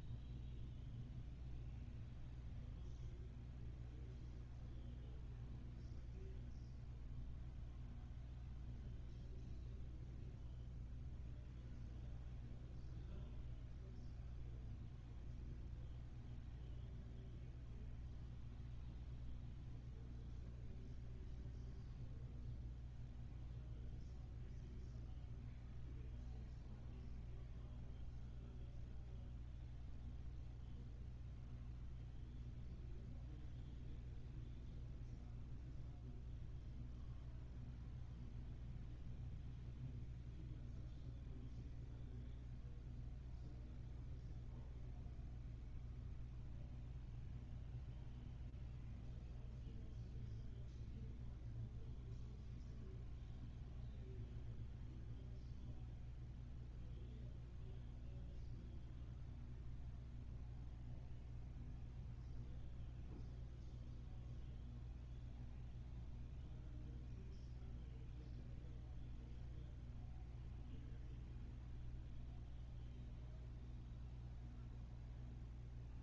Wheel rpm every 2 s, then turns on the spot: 0, 0, 0, 0, 0, 0, 0, 0, 0, 0, 0, 0, 0, 0, 0, 0, 0, 0, 0, 0, 0, 0, 0, 0, 0, 0, 0, 0, 0, 0, 0, 0, 0, 0, 0, 0, 0, 0.
none